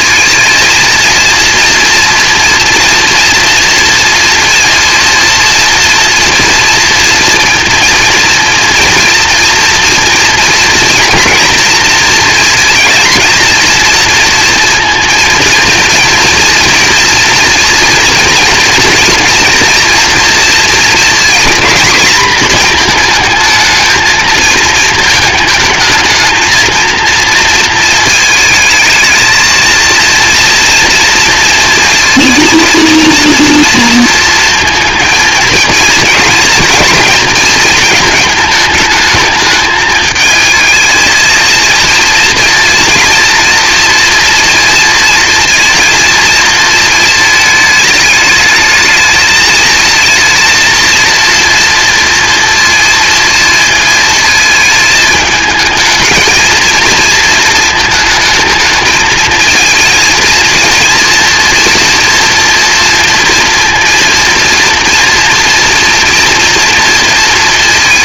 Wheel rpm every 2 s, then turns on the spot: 230, 240, 240, 230, 230, 230, 220, 230, 240, 240, 230, 220, 220, 220, 220, 230, 230, 230, 230, 220, 220, 230, 230, 230, 220, 230, 230, 220, 230, 220, 230, 230, 230, 230.
none